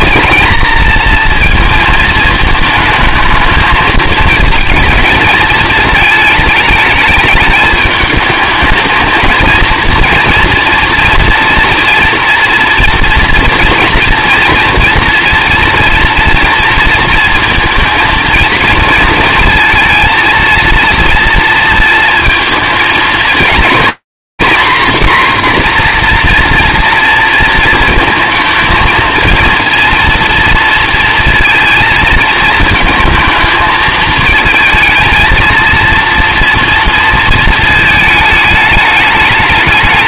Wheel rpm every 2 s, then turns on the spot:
230, 220, 220, 210, 220, 230, 230, 240, 230, 230, 230, 230, 260, 230, 230, 230, 220, 220, 230, 210.
none